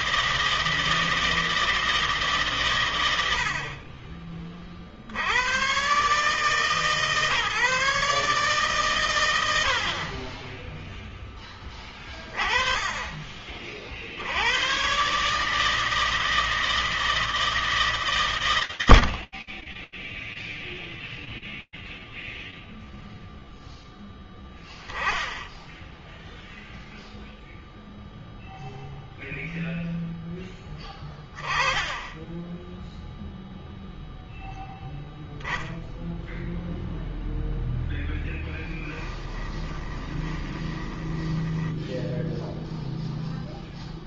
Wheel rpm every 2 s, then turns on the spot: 160, 90, 60, 140, 90, 0, 20, 130, 160, 90, 0, 0, 10, 0, 0, 10, 0, 0, 0, 10, 10, 0.
38-42